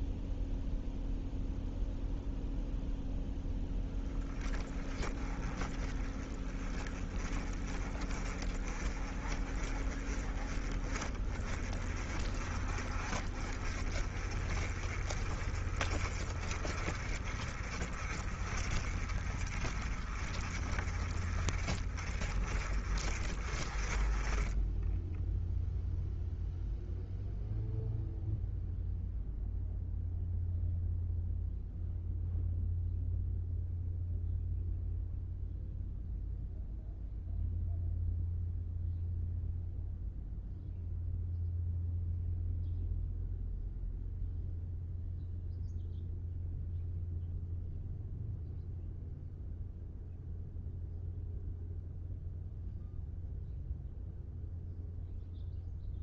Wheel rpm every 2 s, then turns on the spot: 0, 0, 20, 20, 30, 30, 40, 30, 40, 40, 30, 30, 10, 0, 0, 0, 0, 0, 0, 0, 0, 0, 0, 0, 0, 0, 0, 0.
none